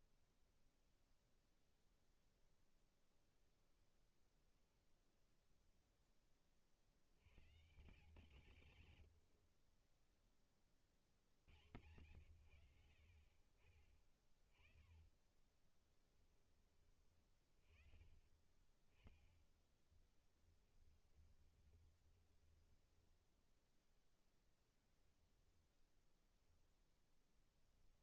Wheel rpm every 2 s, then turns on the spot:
0, 0, 0, 70, 80, 50, 60, 30, 20, 10, 20, 10, 20, 0.
14-16 20-24